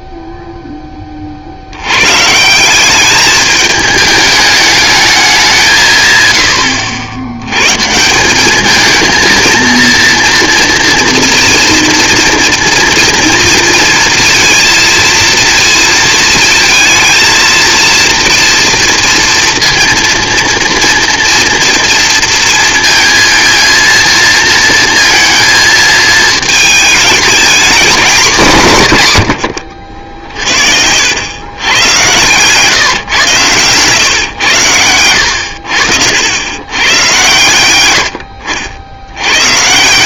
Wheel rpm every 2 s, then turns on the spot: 10, 180, 210, 80, 220, 230, 240, 230, 230, 230, 230, 230, 230, 220, 170, 60, 140, 110, 100, 80.
none